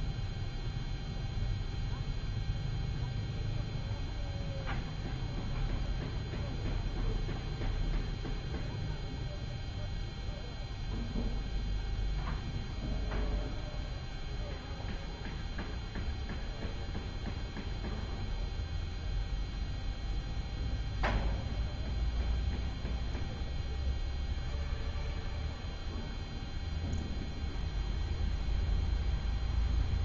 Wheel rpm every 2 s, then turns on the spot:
0, 0, 0, 0, 0, 0, 0, 0, 0, 0, 0, 0, 0, 0, 0.
none